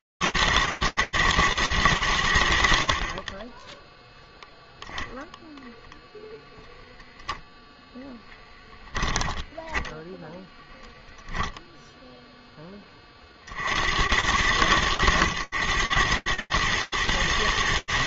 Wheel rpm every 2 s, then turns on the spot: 120, 90, 0, 0, 10, 10, 20, 90, 110.
8-10